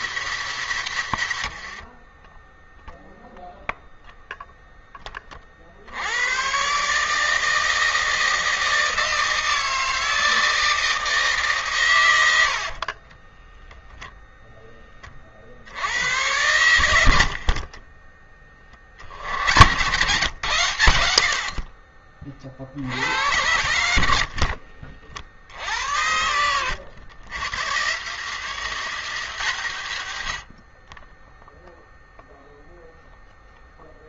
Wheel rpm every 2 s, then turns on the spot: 140, 0, 20, 150, 160, 150, 30, 40, 70, 70, 80, 70, 50, 100, 140, 20, 0.
0-2 12-14 16-18